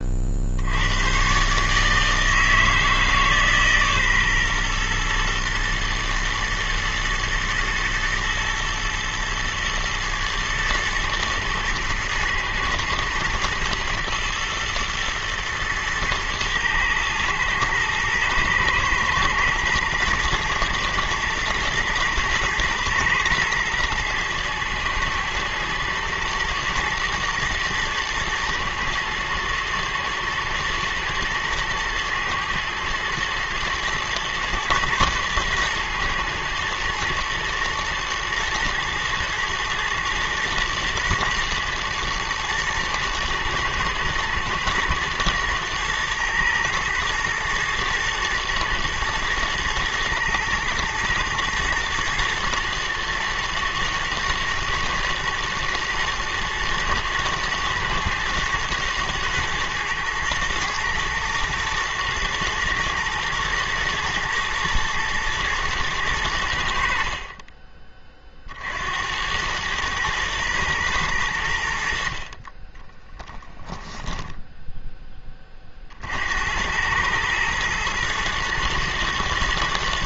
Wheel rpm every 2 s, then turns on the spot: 90, 160, 120, 110, 110, 110, 110, 120, 110, 110, 110, 120, 110, 120, 120, 110, 110, 120, 120, 120, 110, 110, 110, 110, 110, 110, 110, 110, 110, 110, 110, 110, 120, 80, 60, 110, 30, 10, 90, 110.
72-74